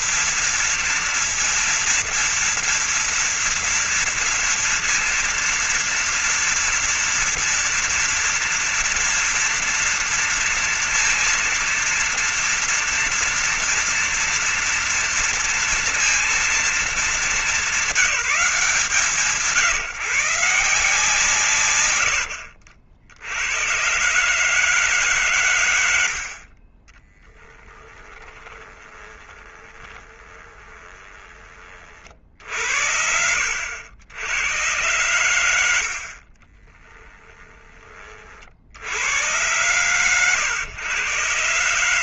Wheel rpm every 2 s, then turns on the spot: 230, 230, 230, 230, 230, 230, 230, 230, 230, 180, 150, 90, 130, 80, 20, 20, 40, 80, 50, 30, 120.
28-32 36-38